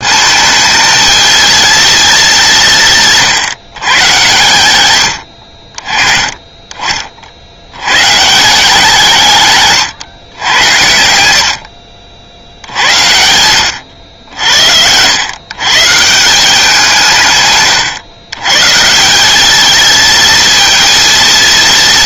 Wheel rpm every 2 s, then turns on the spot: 220, 170, 120, 30, 170, 90, 80, 90, 180, 140, 230.
none